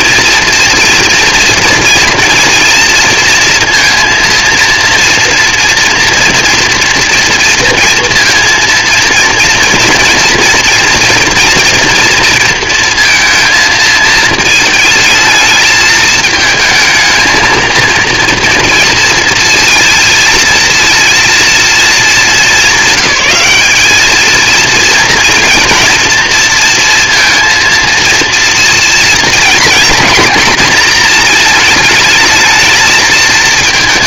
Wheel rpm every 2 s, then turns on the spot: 230, 240, 230, 230, 230, 230, 230, 220, 220, 230, 230, 200, 220, 230, 230, 240, 220.
none